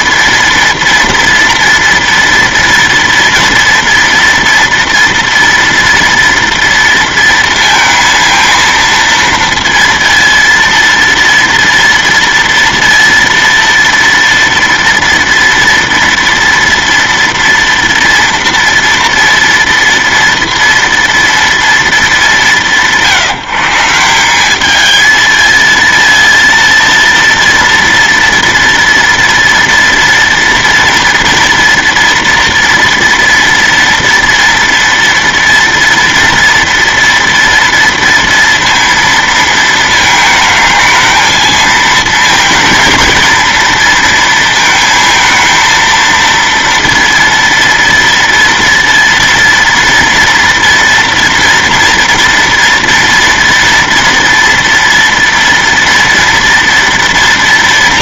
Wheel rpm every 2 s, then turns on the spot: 230, 230, 230, 230, 230, 230, 230, 230, 230, 230, 230, 170, 220, 230, 230, 230, 230, 230, 240, 230, 220, 220, 220, 230, 230, 230, 230, 240, 230.
none